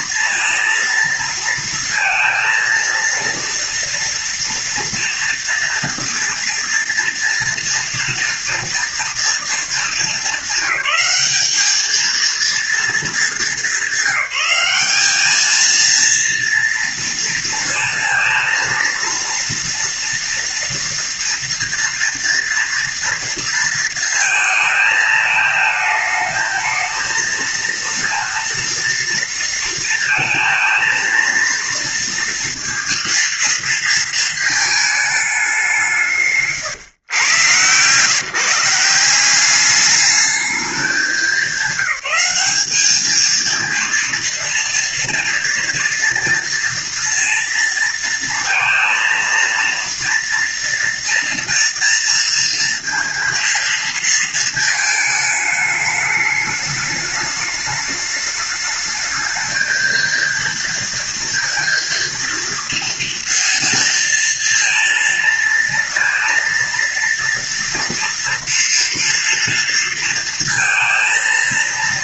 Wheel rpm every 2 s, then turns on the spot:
230, 230, 230, 230, 230, 200, 230, 190, 230, 230, 230, 230, 220, 220, 230, 230, 230, 220, 140, 150, 210, 210, 230, 230, 230, 230, 230, 220, 210, 210, 230, 230, 230, 230, 230, 230.
none